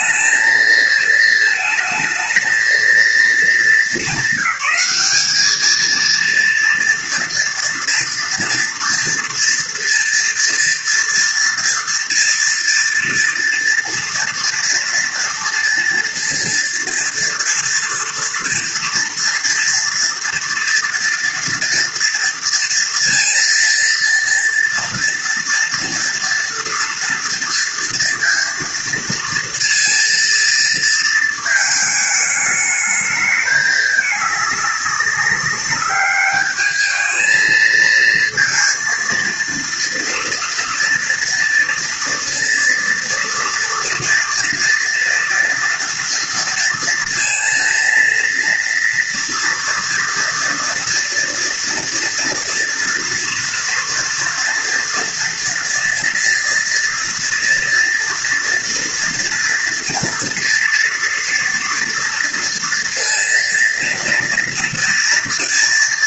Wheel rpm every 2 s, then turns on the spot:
230, 220, 200, 230, 230, 230, 230, 230, 230, 230, 230, 230, 230, 230, 230, 230, 210, 200, 210, 230, 230, 230, 240, 230, 230, 230, 230, 230, 230, 230, 230, 230, 230.
none